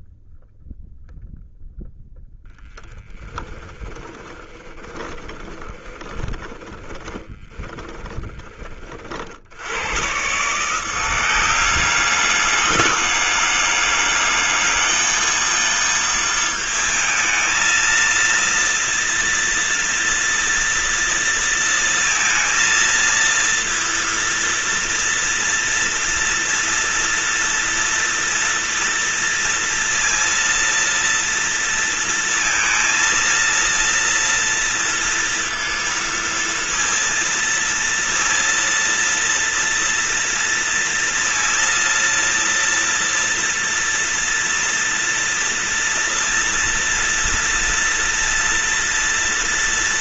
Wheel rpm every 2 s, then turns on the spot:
0, 0, 10, 10, 30, 160, 210, 220, 230, 230, 230, 230, 230, 230, 230, 230, 230, 230, 230, 230, 230, 230, 230, 230, 230.
4-8